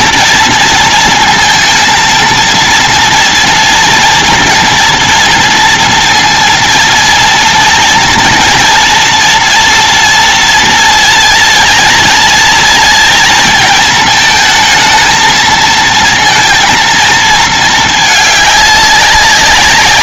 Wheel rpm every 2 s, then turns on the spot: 240, 230, 240, 230, 230, 230, 230, 220, 230, 210.
none